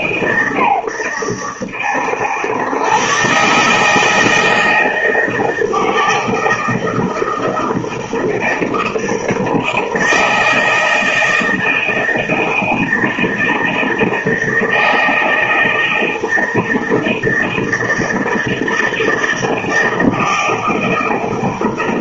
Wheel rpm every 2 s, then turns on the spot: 120, 100, 160, 160, 160, 160, 160, 160, 160, 160, 160.
none